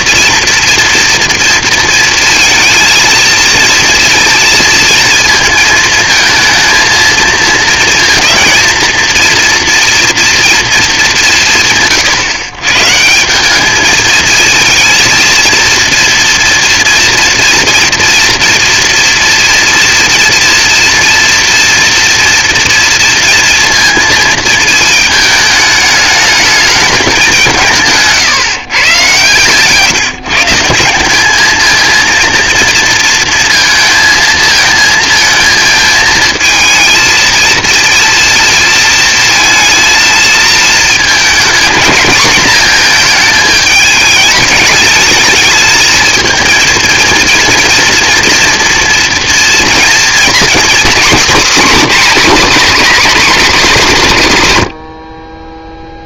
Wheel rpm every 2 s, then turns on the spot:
240, 230, 230, 220, 230, 230, 130, 220, 240, 230, 230, 230, 220, 220, 140, 170, 230, 230, 220, 230, 220, 230, 210, 230, 240, 250, 270, 130.
none